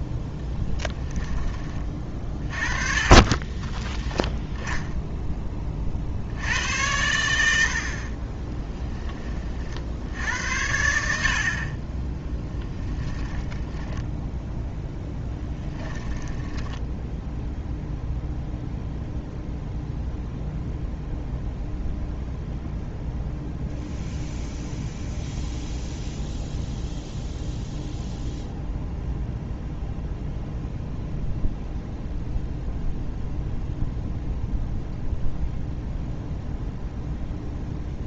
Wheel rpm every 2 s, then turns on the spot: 10, 30, 0, 80, 10, 80, 10, 0, 10, 0, 0, 0, 0, 0, 0, 0, 0, 0, 0.
12-14 16-18